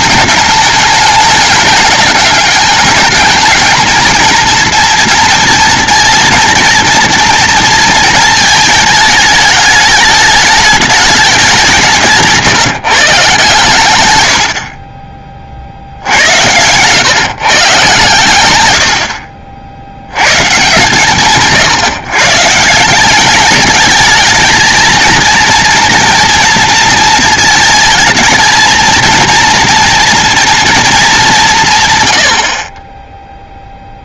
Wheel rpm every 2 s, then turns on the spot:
210, 200, 230, 230, 220, 210, 170, 70, 90, 100, 130, 150, 220, 230, 230, 230, 50.
none